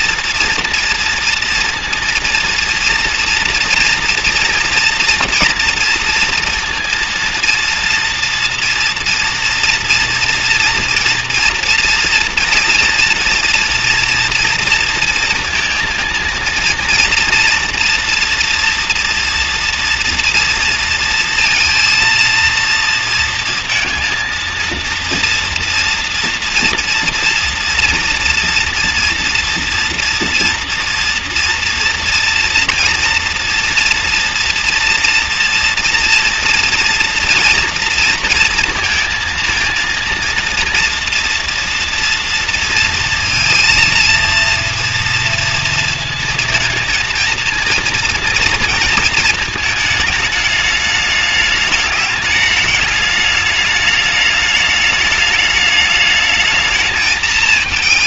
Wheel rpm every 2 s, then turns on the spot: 230, 230, 230, 230, 230, 230, 230, 240, 230, 230, 230, 230, 230, 230, 230, 240, 240, 230, 230, 230, 230, 230, 230, 230, 230, 210, 210, 210, 220.
none